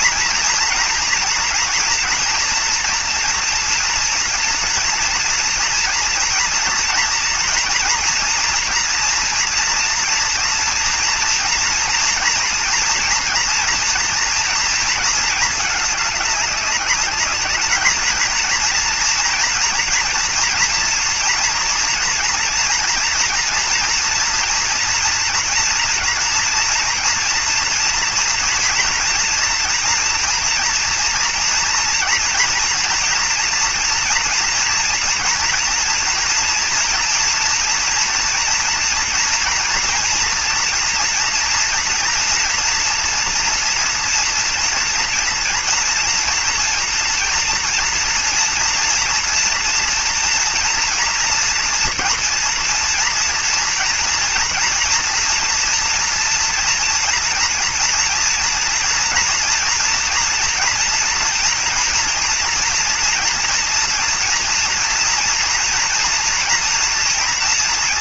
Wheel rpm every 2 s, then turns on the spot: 230, 240, 240, 230, 230, 230, 230, 230, 210, 230, 230, 230, 230, 230, 230, 230, 230, 240, 230, 230, 240, 230, 230, 230, 230, 230, 230, 240, 230, 230, 230, 230, 230, 230.
none